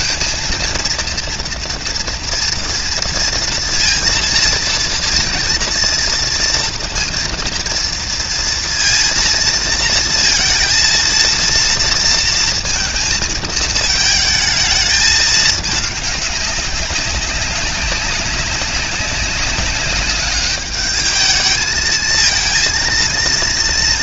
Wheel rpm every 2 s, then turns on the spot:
230, 230, 230, 230, 230, 230, 230, 220, 200, 190, 210, 220.
none